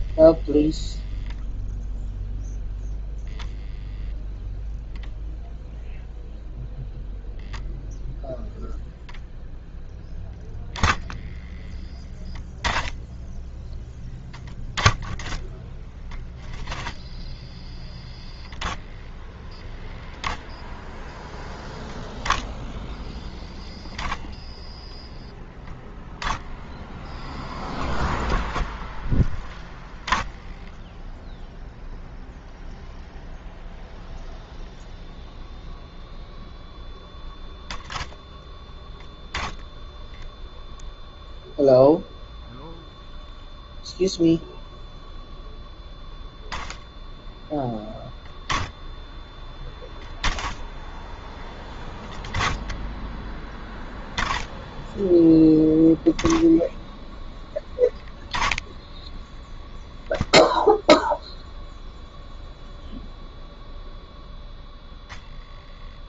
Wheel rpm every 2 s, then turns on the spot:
0, 0, 0, 0, 0, 10, 10, 10, 10, 0, 0, 0, 0, 0, 0, 0, 0, 0, 0, 10, 0, 0, 0, 0, 0, 0, 10, 0, 10, 10, 0, 0, 0.
none